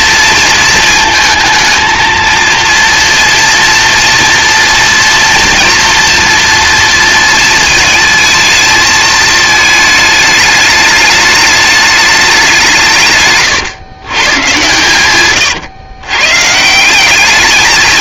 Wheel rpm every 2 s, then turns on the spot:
220, 230, 230, 230, 220, 210, 160, 120, 170.
none